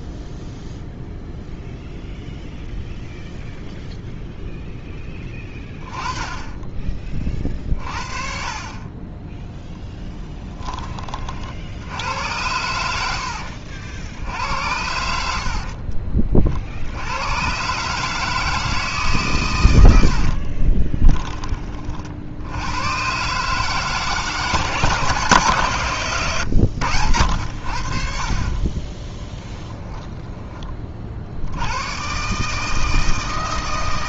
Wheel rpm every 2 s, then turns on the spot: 0, 0, 10, 20, 20, 20, 90, 70, 80, 160, 20, 120, 150, 90, 20, 40, 160.
20-22 28-30